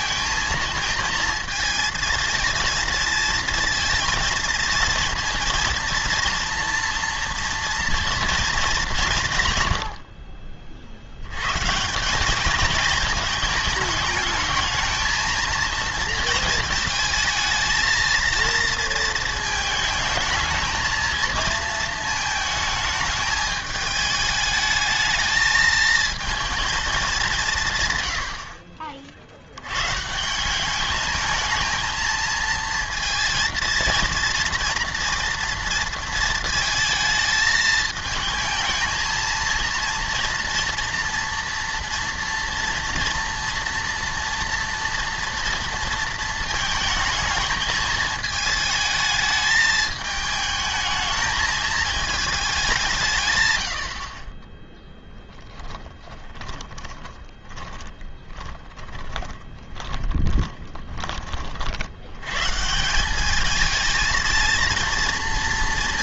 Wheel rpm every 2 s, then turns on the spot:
220, 230, 230, 230, 220, 50, 220, 220, 220, 230, 220, 220, 220, 220, 50, 200, 230, 230, 220, 220, 230, 230, 230, 220, 220, 220, 180, 10, 20, 20, 30, 150, 230.
56-62